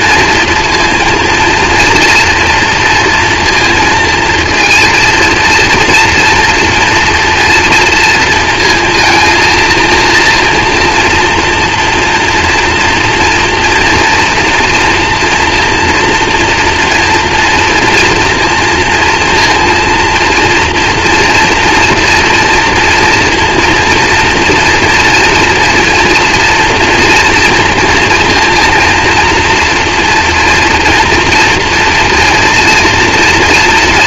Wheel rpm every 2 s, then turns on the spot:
230, 230, 230, 230, 230, 230, 230, 230, 230, 230, 230, 230, 230, 230, 230, 240, 230.
none